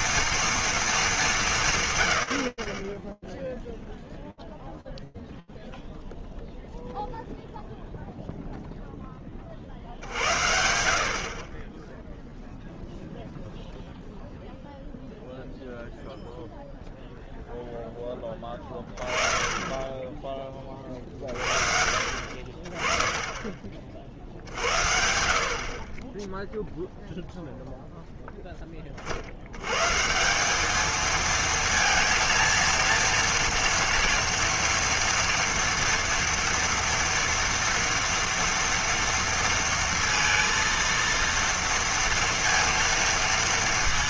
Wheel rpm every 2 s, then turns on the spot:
230, 70, 0, 0, 10, 60, 0, 0, 0, 20, 40, 40, 40, 0, 100, 220, 230, 230, 230, 230, 230, 230.
none